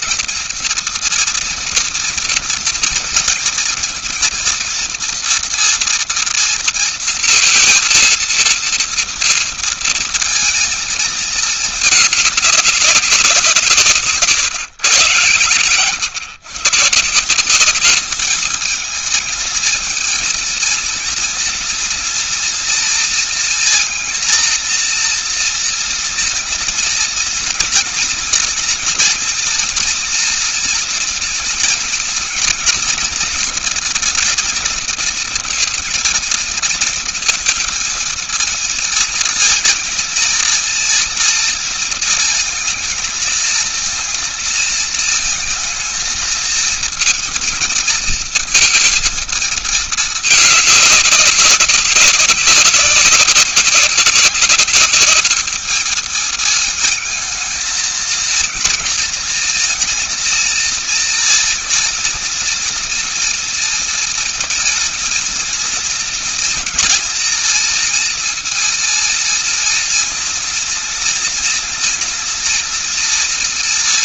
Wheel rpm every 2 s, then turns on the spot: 230, 230, 230, 230, 230, 230, 210, 140, 130, 210, 230, 230, 230, 230, 230, 230, 240, 230, 230, 230, 230, 220, 230, 230, 230, 210, 190, 200, 220, 220, 230, 240, 240, 230, 230, 230, 230.
none